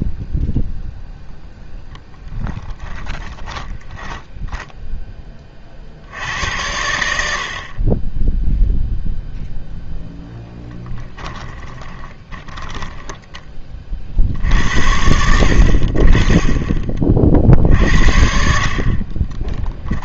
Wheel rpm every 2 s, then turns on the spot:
0, 10, 10, 80, 0, 10, 10, 70, 20, 50.
2-6 10-14